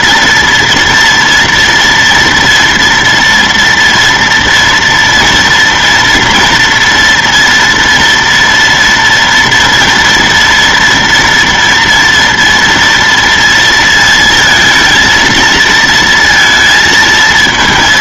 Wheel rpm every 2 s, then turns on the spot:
230, 230, 230, 230, 230, 230, 230, 220, 230.
none